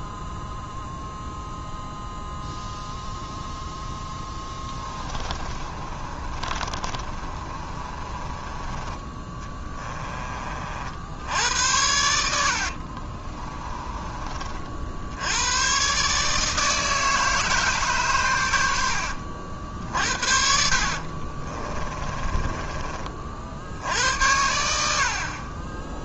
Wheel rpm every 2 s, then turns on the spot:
0, 0, 20, 30, 20, 70, 50, 60, 160, 70, 50, 30, 70.
4-8 12-14 20-22